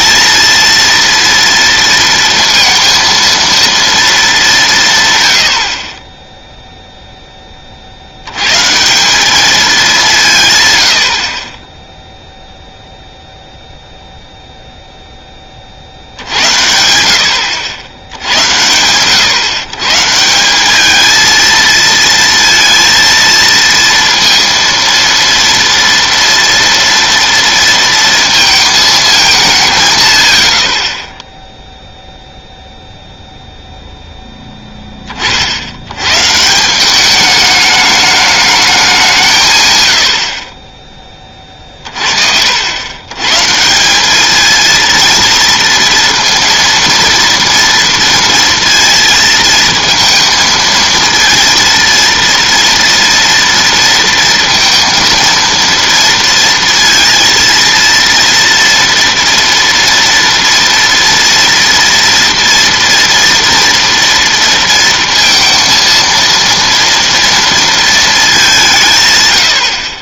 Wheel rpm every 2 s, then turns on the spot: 230, 230, 190, 0, 130, 120, 0, 0, 80, 100, 200, 230, 230, 230, 220, 50, 0, 10, 170, 210, 30, 80, 220, 230, 230, 230, 230, 230, 230, 230, 230, 230, 230, 230, 180.
none